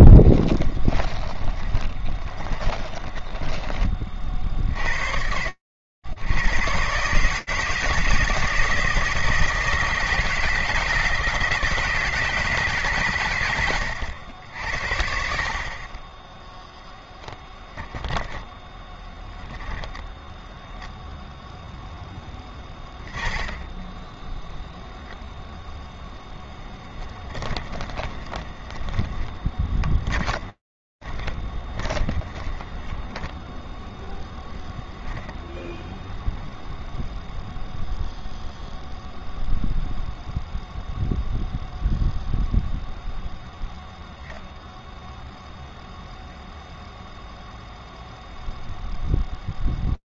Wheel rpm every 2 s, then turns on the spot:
20, 20, 30, 60, 160, 170, 160, 90, 10, 10, 0, 20, 0, 10, 20, 30, 30, 0, 0, 0, 0, 0, 0, 0, 0.
0-4 18-20 26-34